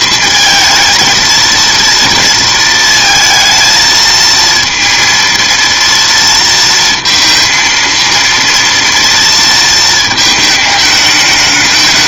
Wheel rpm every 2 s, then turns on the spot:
220, 220, 230, 230, 230, 210.
none